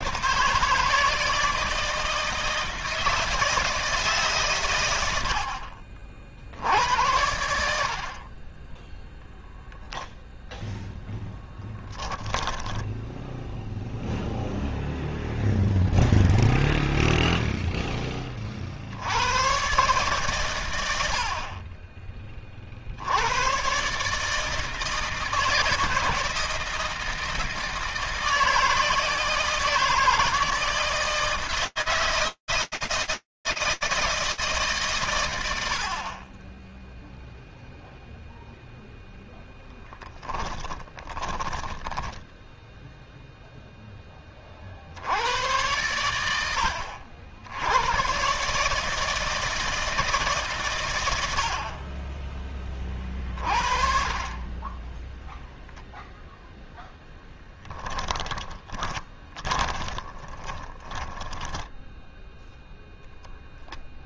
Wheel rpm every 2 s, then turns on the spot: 140, 160, 120, 70, 10, 0, 10, 0, 0, 40, 120, 40, 150, 160, 160, 160, 160, 60, 0, 0, 20, 0, 90, 80, 160, 90, 30, 0, 10, 20, 10, 0.
12-14 40-42 56-62